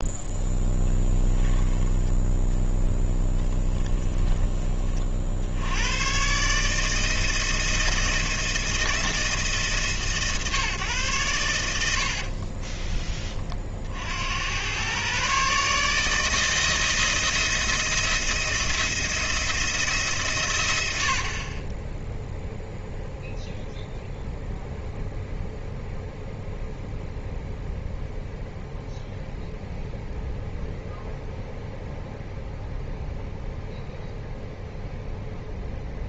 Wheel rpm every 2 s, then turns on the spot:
0, 0, 20, 140, 160, 140, 40, 90, 160, 170, 110, 0, 0, 0, 0, 0, 0, 0.
12-14